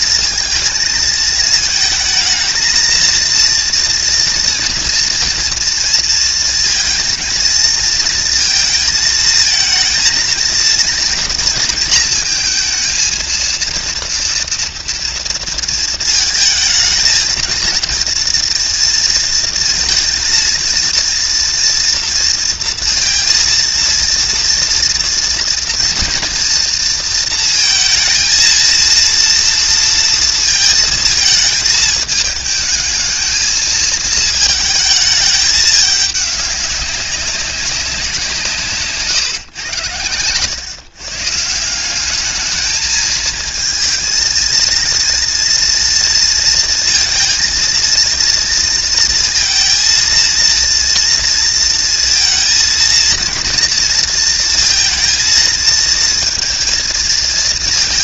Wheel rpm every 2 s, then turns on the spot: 230, 230, 230, 230, 220, 230, 230, 240, 220, 230, 230, 230, 230, 230, 220, 230, 220, 220, 200, 150, 120, 220, 230, 220, 230, 230, 230, 230, 230.
none